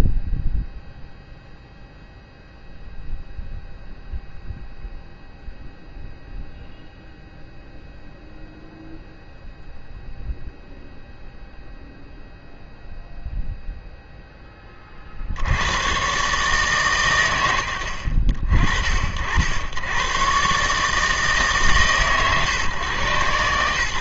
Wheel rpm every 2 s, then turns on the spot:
0, 0, 0, 0, 0, 0, 0, 30, 140, 50, 150, 130.
none